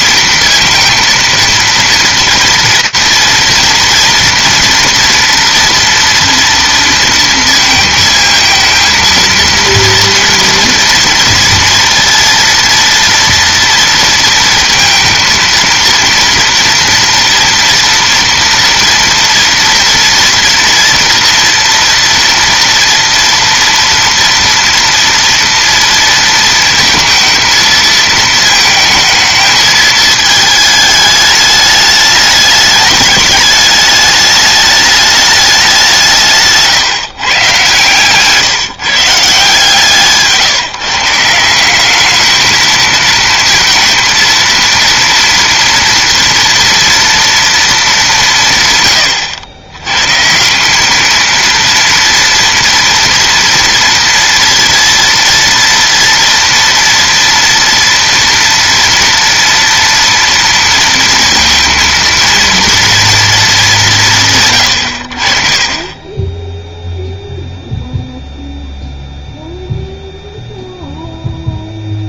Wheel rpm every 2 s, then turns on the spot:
230, 230, 240, 230, 230, 230, 230, 230, 230, 230, 240, 230, 230, 230, 220, 220, 210, 210, 150, 150, 160, 220, 230, 240, 140, 190, 230, 230, 230, 230, 230, 230, 120, 0, 0, 0.
none